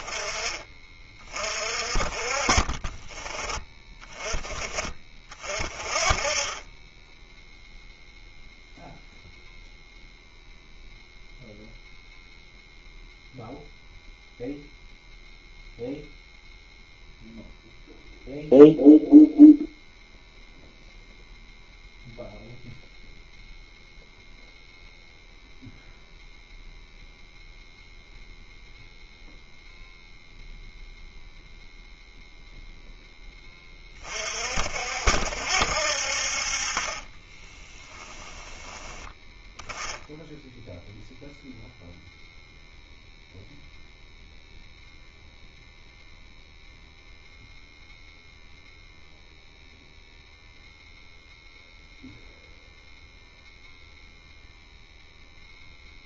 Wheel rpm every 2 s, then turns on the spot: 20, 40, 20, 20, 0, 0, 0, 0, 0, 0, 0, 0, 0, 0, 0, 0, 0, 50, 40, 10, 0, 0, 0, 0, 0, 0, 0, 0.
none